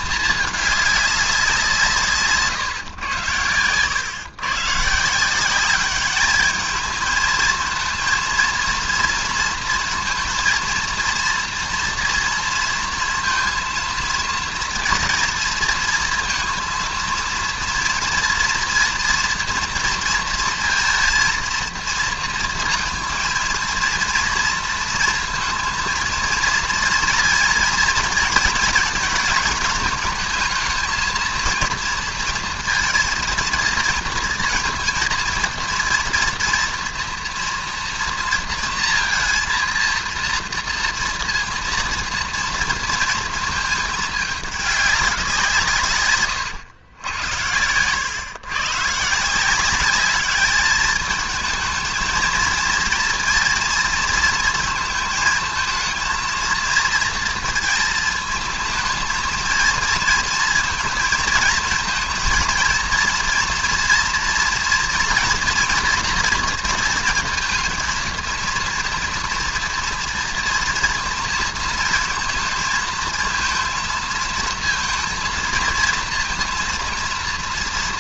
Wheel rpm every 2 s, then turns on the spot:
210, 140, 140, 220, 230, 230, 230, 230, 230, 240, 230, 230, 230, 230, 230, 220, 230, 230, 230, 230, 230, 230, 200, 100, 130, 210, 230, 220, 230, 230, 230, 230, 230, 230, 230, 230, 230, 230, 230.
none